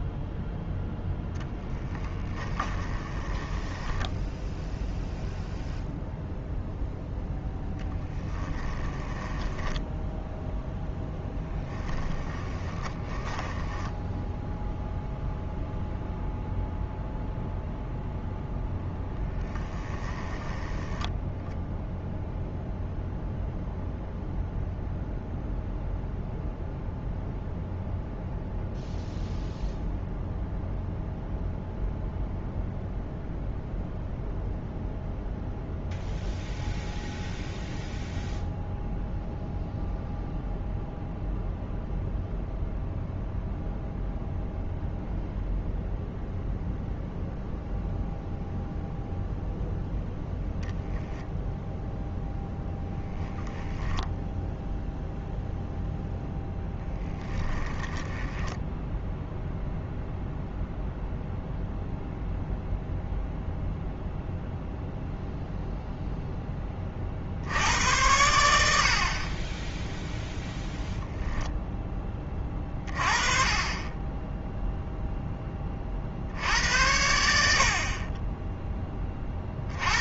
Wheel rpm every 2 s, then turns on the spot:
0, 20, 0, 0, 10, 0, 20, 0, 0, 0, 10, 0, 0, 0, 0, 0, 0, 0, 0, 0, 0, 0, 0, 0, 0, 0, 0, 0, 10, 0, 0, 0, 0, 20, 70, 0, 30, 0, 80, 10.
2-4 8-10 12-14 20-22 56-58